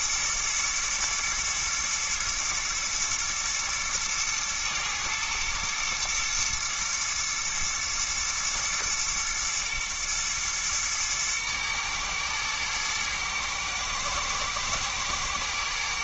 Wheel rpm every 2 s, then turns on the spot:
110, 110, 120, 120, 120, 120, 110, 110.
none